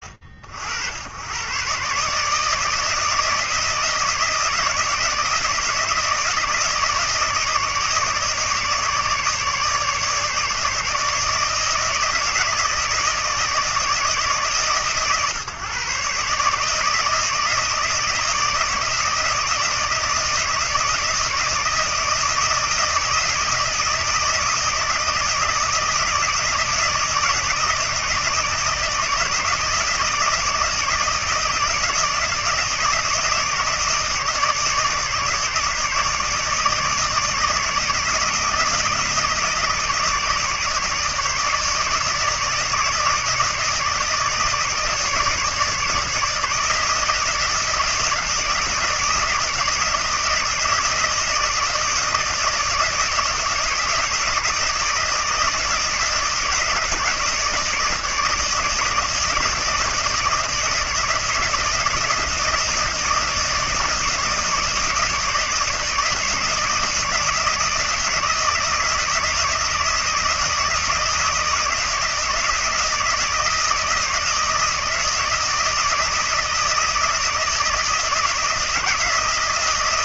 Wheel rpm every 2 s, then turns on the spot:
70, 160, 160, 160, 150, 150, 160, 150, 150, 160, 160, 160, 160, 160, 160, 160, 160, 150, 160, 160, 160, 160, 150, 160, 160, 160, 160, 160, 160, 160, 160, 160, 160, 160, 170, 160, 160, 160, 160, 160.
none